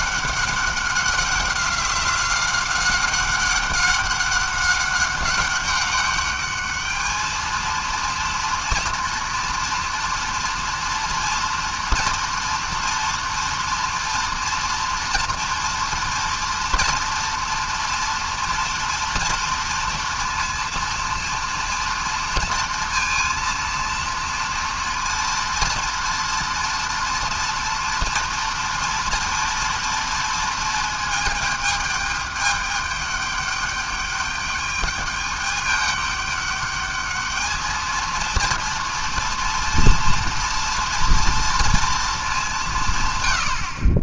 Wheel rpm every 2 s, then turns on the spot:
200, 190, 200, 210, 230, 230, 240, 230, 230, 230, 230, 230, 230, 240, 240, 230, 210, 210, 210, 230, 230, 190.
none